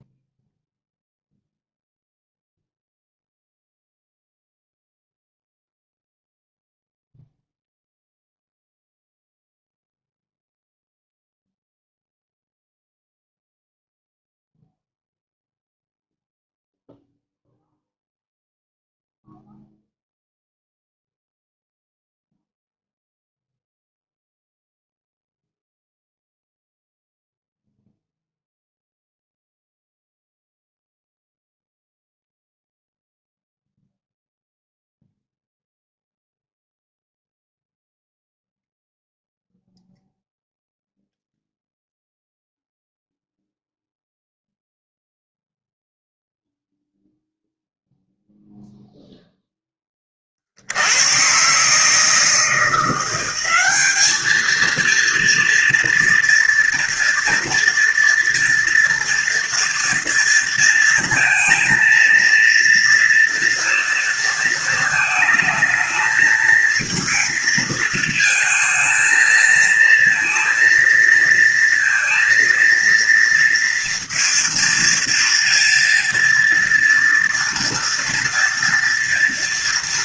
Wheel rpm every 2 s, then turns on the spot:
0, 0, 0, 0, 0, 0, 0, 0, 0, 0, 0, 0, 0, 0, 0, 0, 0, 0, 0, 0, 0, 0, 0, 0, 0, 90, 170, 230, 230, 230, 230, 230, 220, 220, 220, 230, 230, 230, 230, 230.
none